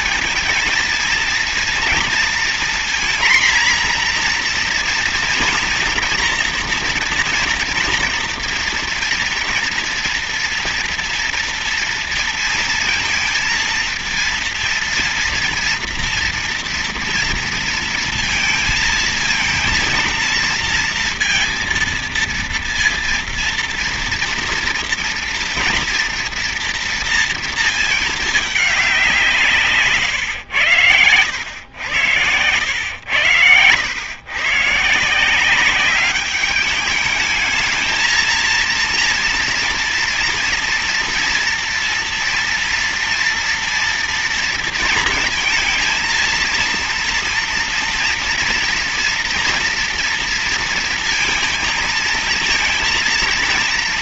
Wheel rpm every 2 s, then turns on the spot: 230, 240, 240, 230, 230, 230, 230, 230, 240, 220, 230, 230, 230, 230, 220, 110, 100, 130, 210, 230, 240, 230, 230, 230, 230, 230, 230.
none